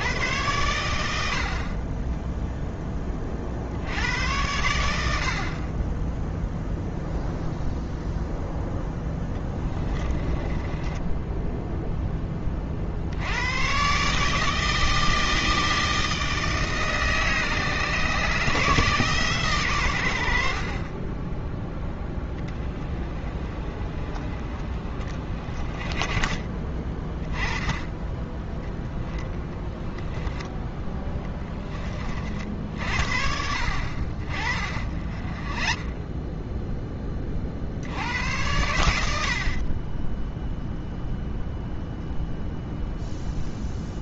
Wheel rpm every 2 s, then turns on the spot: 110, 10, 90, 0, 10, 20, 40, 160, 150, 150, 40, 20, 30, 20, 10, 10, 60, 30, 10, 90, 0, 0.
8-12 28-32